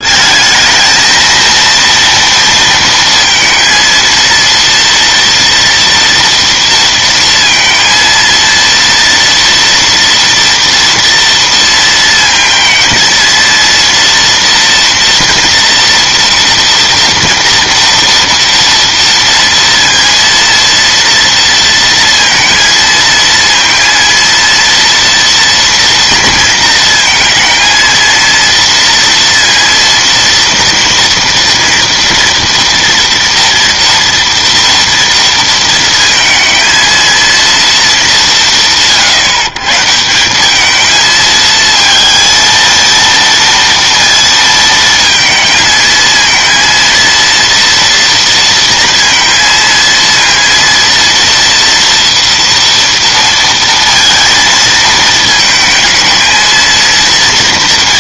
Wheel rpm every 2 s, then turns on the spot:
220, 230, 230, 230, 230, 230, 230, 230, 230, 230, 230, 230, 230, 230, 230, 230, 230, 230, 230, 160, 200, 230, 230, 230, 230, 230, 230, 230, 220.
none